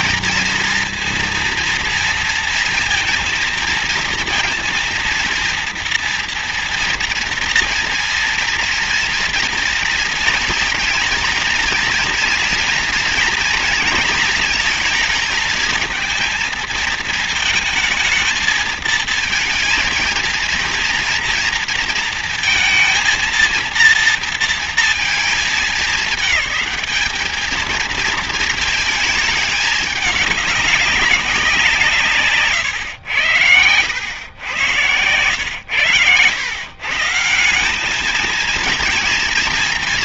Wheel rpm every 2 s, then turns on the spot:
230, 230, 230, 230, 230, 230, 240, 230, 220, 220, 230, 230, 230, 220, 220, 210, 130, 110, 120, 220.
32-34